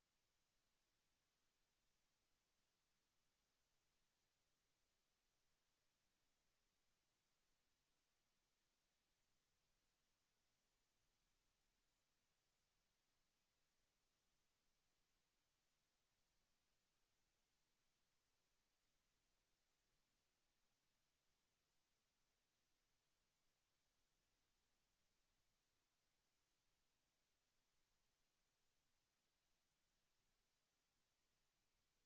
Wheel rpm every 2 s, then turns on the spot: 0, 0, 0, 0, 0, 0, 0, 0, 0, 0, 0, 0, 0, 0, 0, 0.
none